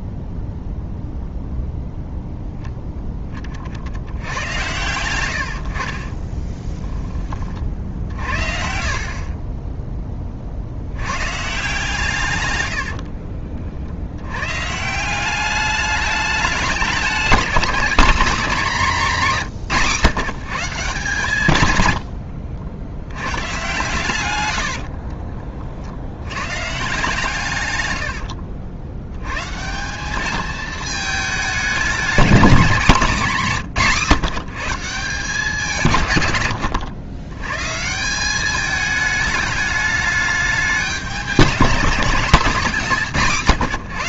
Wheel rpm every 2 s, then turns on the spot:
0, 0, 110, 10, 50, 80, 90, 150, 200, 220, 160, 90, 60, 150, 80, 220, 210, 160, 90, 210, 190, 200.
12-14 24-26